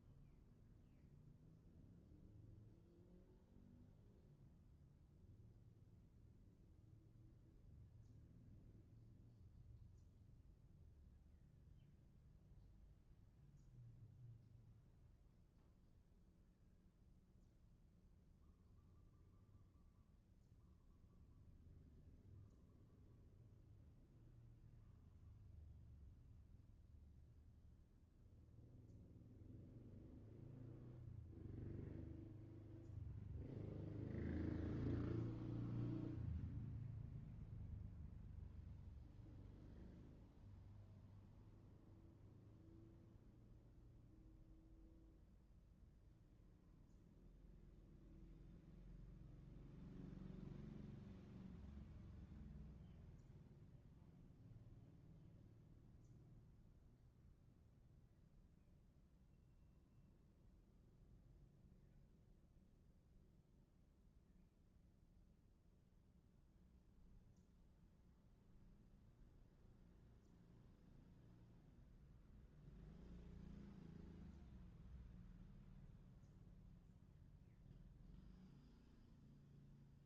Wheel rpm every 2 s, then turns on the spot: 0, 0, 0, 0, 0, 0, 0, 0, 0, 0, 0, 0, 0, 0, 0, 0, 0, 0, 0, 0, 0, 0, 0, 0, 0, 0, 0, 0, 0, 0, 0, 0, 0, 0, 0, 0, 0, 0, 0, 0.
none